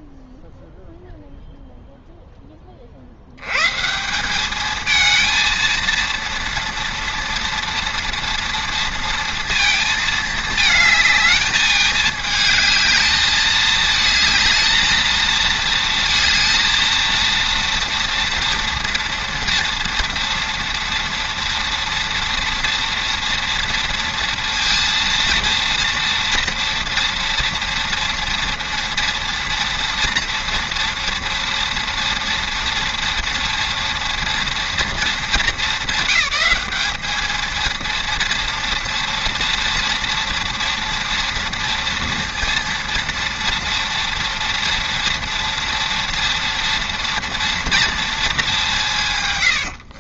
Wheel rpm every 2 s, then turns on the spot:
0, 20, 210, 230, 230, 220, 220, 220, 230, 230, 230, 230, 230, 230, 240, 230, 230, 230, 210, 230, 230, 230, 230, 230, 190.
none